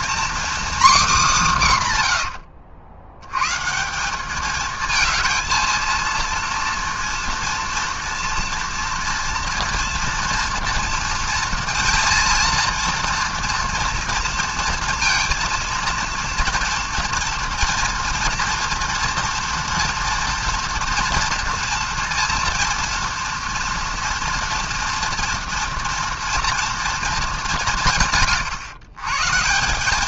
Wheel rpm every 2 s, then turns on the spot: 270, 80, 210, 230, 230, 230, 230, 230, 230, 240, 230, 230, 240, 230, 120.
2-4